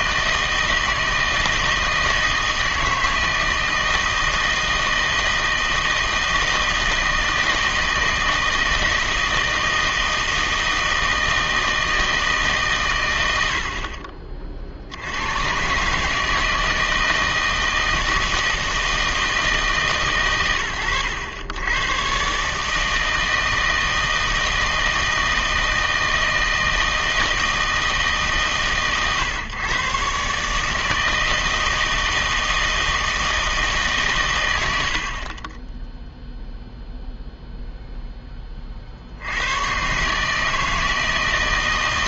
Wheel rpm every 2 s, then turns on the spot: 160, 160, 160, 160, 160, 160, 130, 50, 160, 160, 100, 150, 160, 160, 130, 150, 160, 100, 0, 40, 160.
none